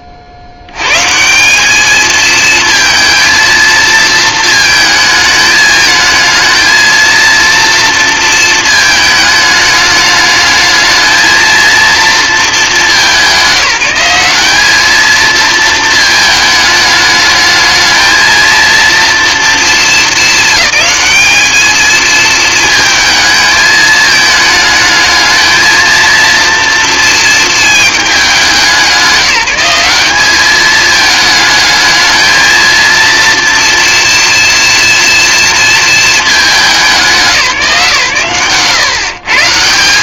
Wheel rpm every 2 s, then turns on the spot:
110, 230, 220, 220, 220, 220, 200, 210, 210, 230, 210, 220, 220, 230, 190, 220, 230, 230, 180, 150.
none